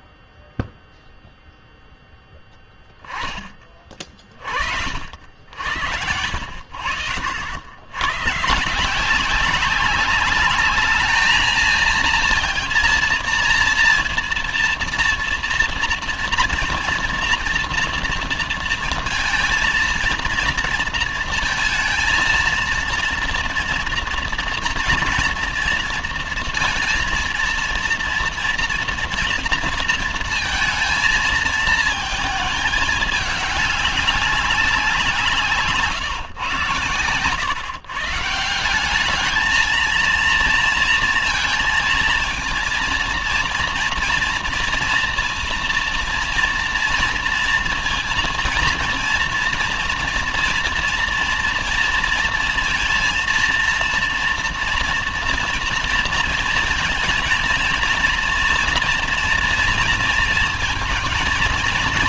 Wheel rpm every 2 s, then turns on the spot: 0, 10, 40, 80, 140, 210, 230, 230, 230, 230, 230, 230, 230, 230, 230, 230, 220, 190, 120, 180, 230, 230, 230, 230, 240, 240, 230, 230, 230, 230, 230.
none